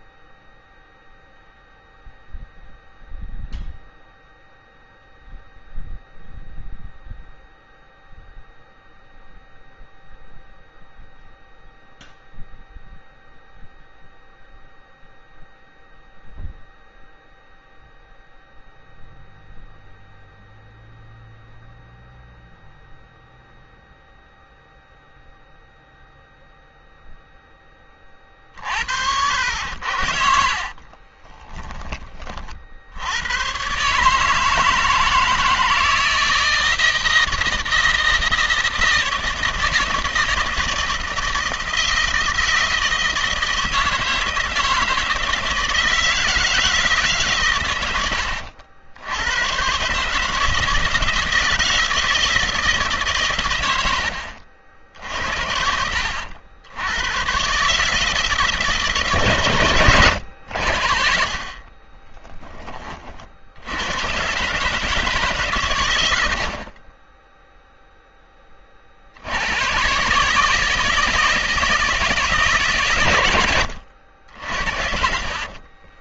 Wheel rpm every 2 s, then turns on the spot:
0, 0, 0, 0, 0, 0, 0, 0, 0, 0, 0, 0, 0, 0, 40, 50, 30, 150, 160, 160, 160, 160, 160, 160, 100, 150, 160, 70, 80, 150, 80, 20, 120, 90, 10, 140, 150, 60.
30-32 62-64